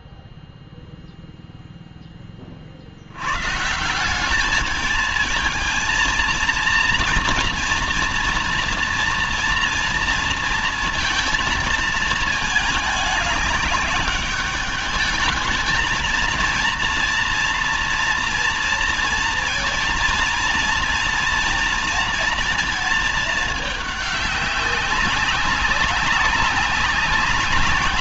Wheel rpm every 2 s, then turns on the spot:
0, 70, 210, 230, 230, 230, 210, 210, 230, 230, 230, 220, 200, 200.
none